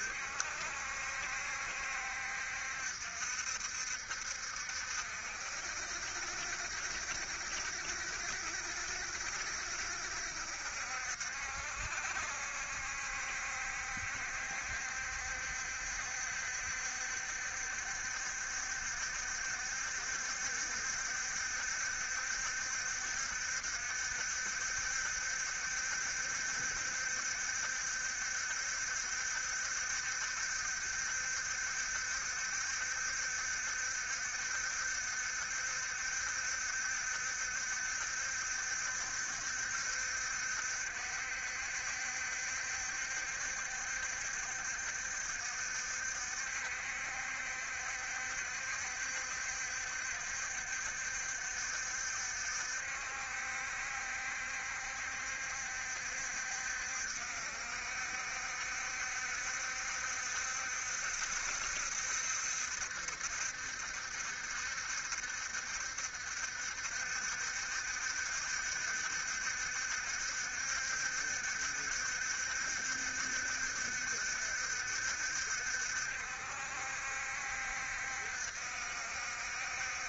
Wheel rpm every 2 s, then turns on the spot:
70, 60, 60, 60, 70, 60, 70, 70, 70, 70, 60, 70, 70, 70, 60, 70, 70, 70, 70, 70, 60, 70, 70, 70, 70, 70, 60, 70, 70, 70, 70, 70, 70, 70, 70, 70, 70, 60, 70, 70.
none